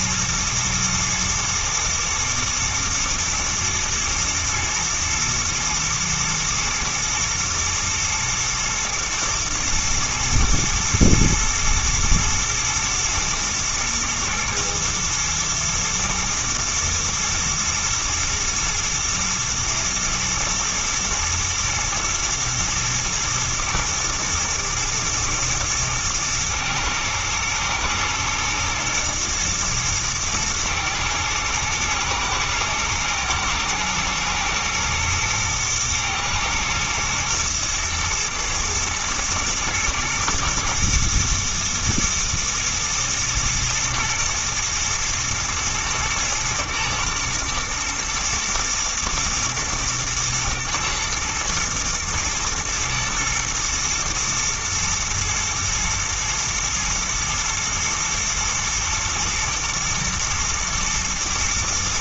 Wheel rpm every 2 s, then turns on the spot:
120, 110, 110, 120, 120, 120, 120, 120, 120, 120, 110, 110, 110, 110, 110, 110, 120, 110, 120, 110, 110, 120, 120, 110, 120, 120, 110, 110, 110, 120, 110.
none